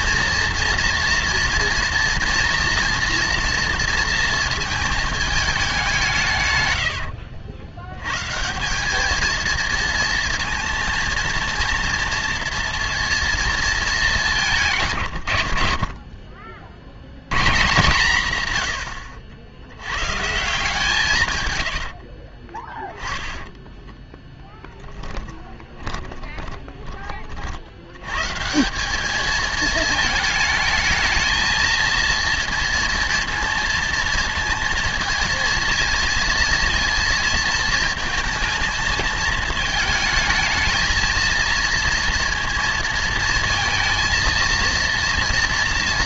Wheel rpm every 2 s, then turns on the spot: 230, 240, 220, 110, 190, 230, 230, 150, 50, 120, 150, 20, 20, 20, 190, 220, 230, 230, 230, 220, 220, 230, 230.
22-28